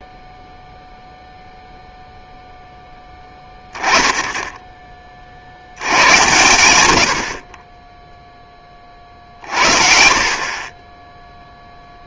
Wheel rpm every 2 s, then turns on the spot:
0, 10, 10, 100, 40, 20.
none